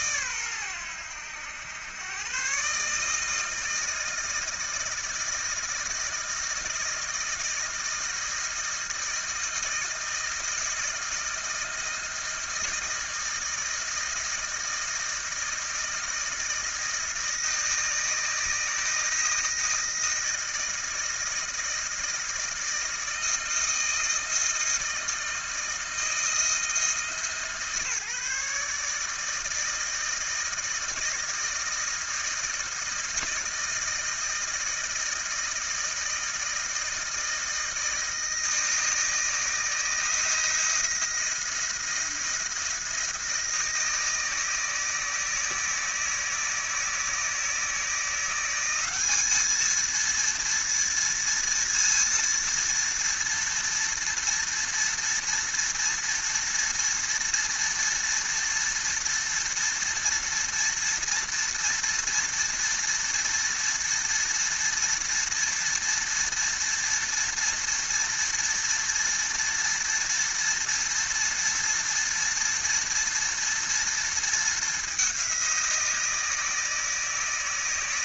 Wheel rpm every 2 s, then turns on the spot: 110, 130, 160, 160, 160, 160, 160, 160, 160, 160, 160, 160, 160, 160, 150, 160, 160, 160, 160, 160, 170, 170, 160, 160, 180, 230, 230, 230, 230, 230, 230, 230, 230, 230, 230, 230, 230, 220, 160.
none